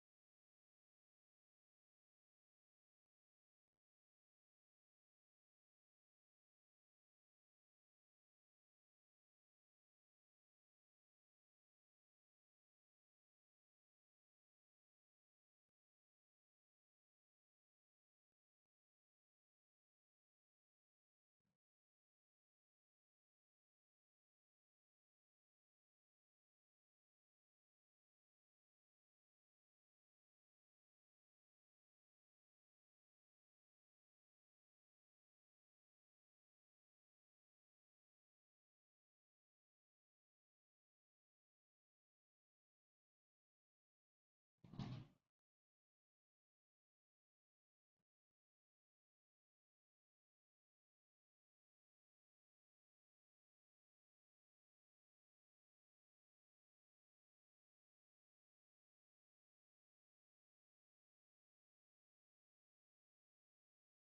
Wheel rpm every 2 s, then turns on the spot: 0, 0, 0, 0, 0, 0, 0, 0, 0, 0, 0, 0, 0, 0, 0, 0, 0, 0, 0, 0, 0, 0, 0, 0, 0, 0, 0, 0, 0, 0, 0, 0.
none